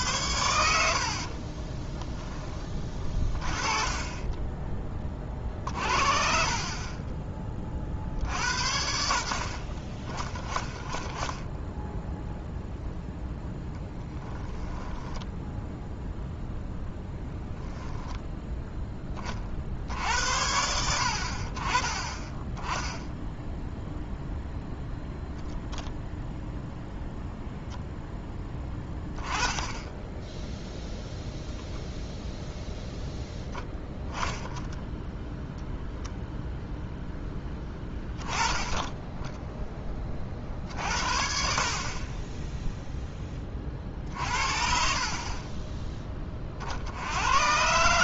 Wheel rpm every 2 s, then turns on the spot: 80, 30, 20, 30, 50, 10, 0, 10, 0, 10, 80, 10, 0, 0, 10, 0, 0, 0, 0, 10, 60, 0, 50, 60.
0-2 6-8 14-16